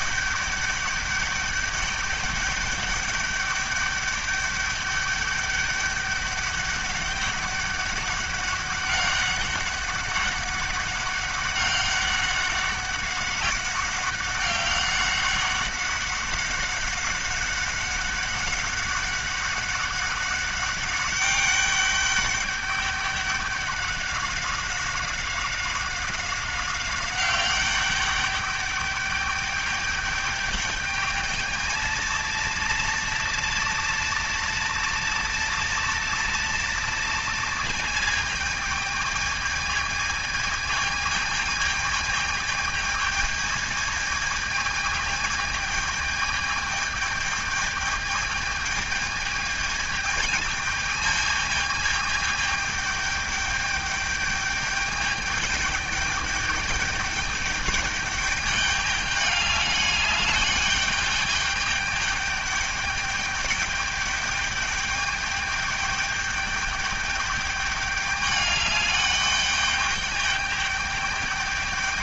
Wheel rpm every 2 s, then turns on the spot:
200, 200, 200, 200, 200, 190, 190, 200, 200, 200, 200, 200, 190, 190, 200, 210, 230, 230, 230, 210, 220, 220, 220, 220, 210, 220, 210, 210, 210, 200, 210, 210, 210, 210, 200, 210.
none